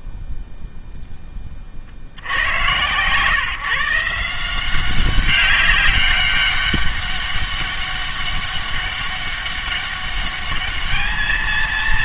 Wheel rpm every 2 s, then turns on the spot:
0, 100, 180, 200, 200, 210.
none